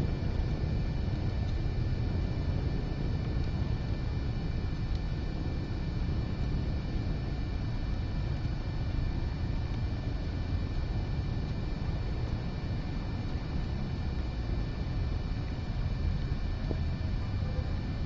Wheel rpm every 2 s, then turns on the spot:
0, 0, 0, 0, 0, 0, 0, 0, 0.
none